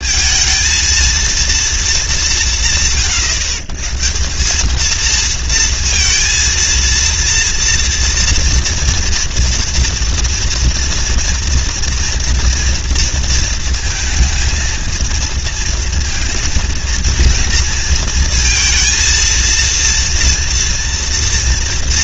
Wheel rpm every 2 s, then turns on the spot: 230, 170, 210, 230, 240, 230, 230, 220, 230, 230, 230.
none